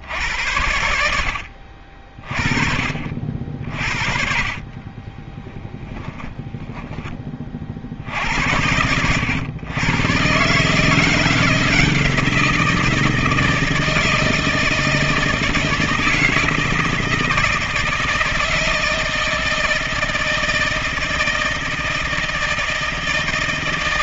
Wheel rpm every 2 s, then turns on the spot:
80, 40, 50, 20, 80, 140, 170, 160, 160, 160, 160, 160.
4-8